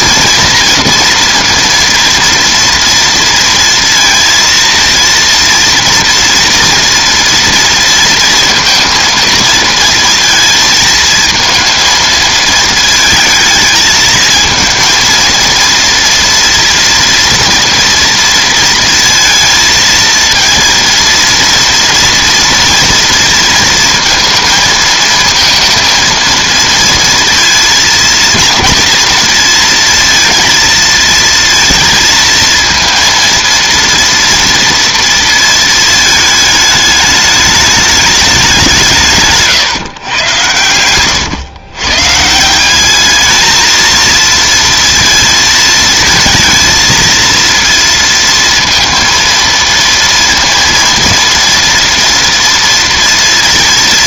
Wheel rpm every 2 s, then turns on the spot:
240, 230, 230, 230, 230, 220, 220, 230, 230, 230, 230, 230, 230, 230, 230, 230, 230, 230, 210, 180, 110, 190, 230, 230, 230, 230, 230.
none